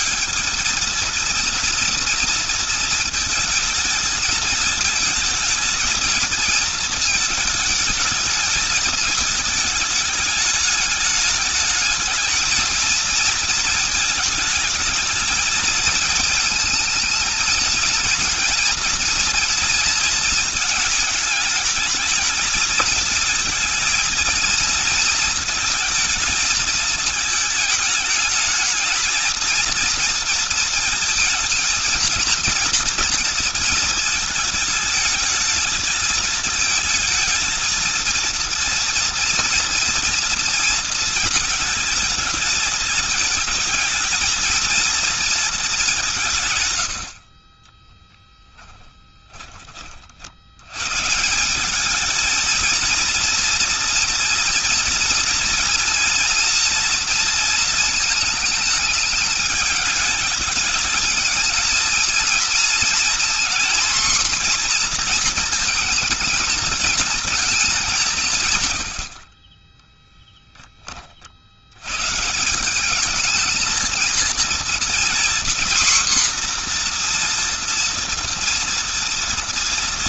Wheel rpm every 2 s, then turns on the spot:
200, 230, 220, 220, 210, 210, 220, 210, 220, 230, 220, 220, 230, 220, 220, 230, 230, 220, 220, 230, 230, 220, 230, 130, 10, 110, 230, 230, 230, 220, 210, 230, 240, 220, 140, 10, 170, 230, 250, 230.
48-50